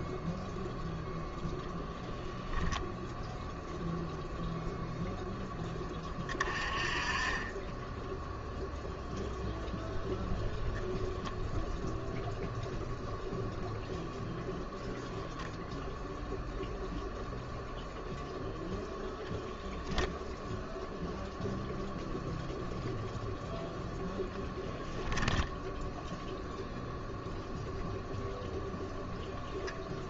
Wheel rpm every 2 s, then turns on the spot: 0, 20, 0, 30, 0, 0, 0, 0, 0, 0, 0, 0, 10, 0, 0.
2-4